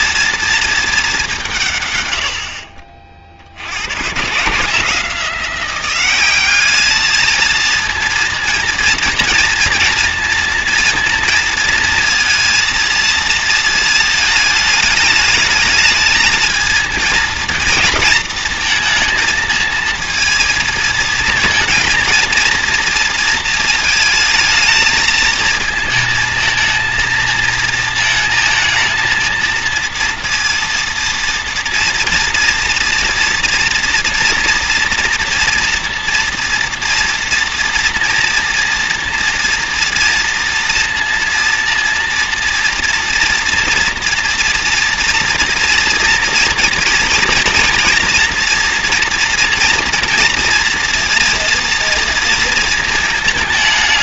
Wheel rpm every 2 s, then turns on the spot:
230, 60, 160, 200, 230, 230, 230, 220, 220, 230, 230, 230, 220, 220, 220, 230, 230, 230, 230, 230, 230, 230, 240, 230, 230, 230, 220.
none